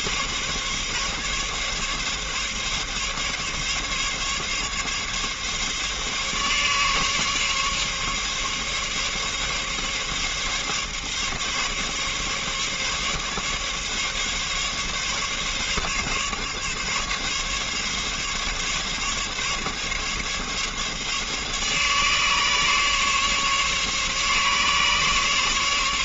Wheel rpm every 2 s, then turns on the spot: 140, 140, 140, 140, 140, 140, 140, 140, 140, 140, 140, 140, 140.
none